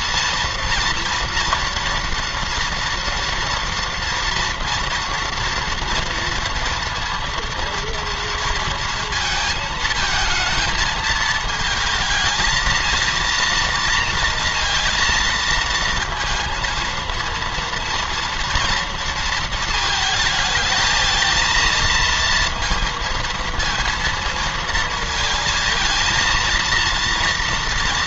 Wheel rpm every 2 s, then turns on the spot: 230, 230, 230, 230, 230, 220, 230, 230, 230, 230, 220, 230, 230, 240.
none